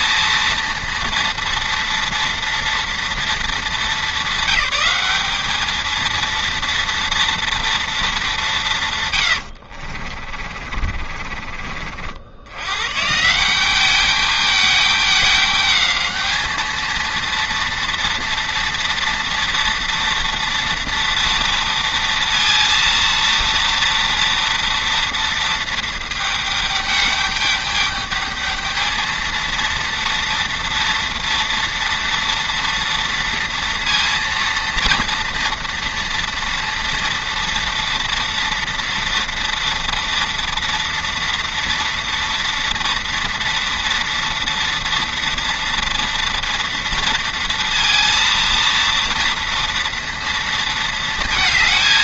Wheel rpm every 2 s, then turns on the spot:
230, 230, 200, 230, 160, 50, 110, 210, 220, 230, 230, 230, 230, 210, 220, 230, 230, 230, 230, 230, 230, 230, 230, 230, 230, 230.
10-12